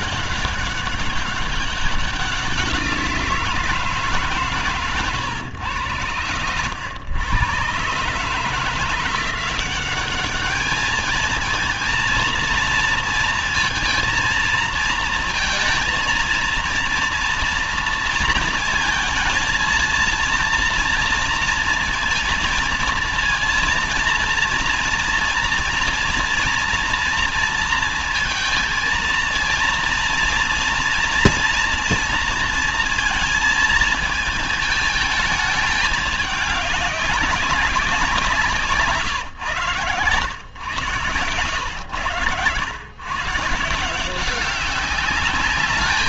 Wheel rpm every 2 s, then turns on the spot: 190, 180, 140, 100, 150, 210, 230, 230, 230, 230, 230, 230, 230, 230, 220, 230, 230, 210, 200, 170, 120, 110, 190.
none